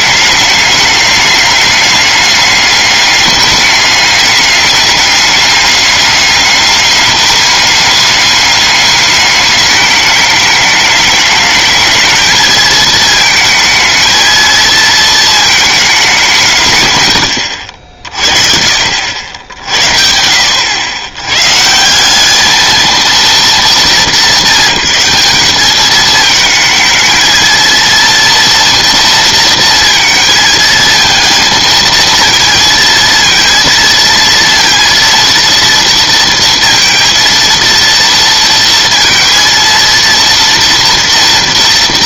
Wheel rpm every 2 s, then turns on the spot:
210, 210, 210, 210, 210, 210, 220, 230, 130, 70, 100, 230, 190, 220, 230, 220, 230, 230, 230, 230, 230.
none